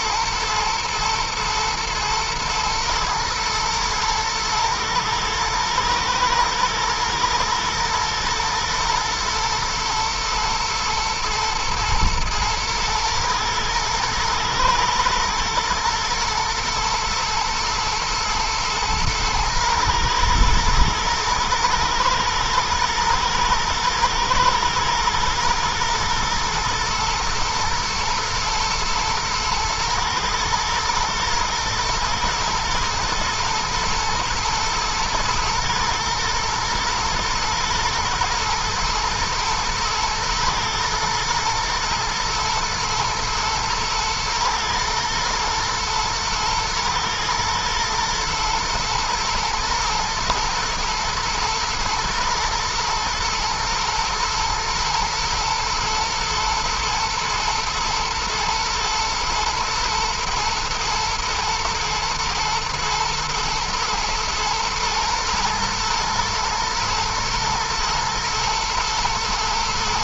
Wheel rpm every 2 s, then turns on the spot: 120, 110, 110, 110, 110, 110, 110, 110, 120, 120, 120, 120, 120, 120, 120, 120, 120, 110, 110, 110, 120, 110, 120, 120, 110, 110, 120, 120, 110, 110, 120, 120, 120, 120, 120.
none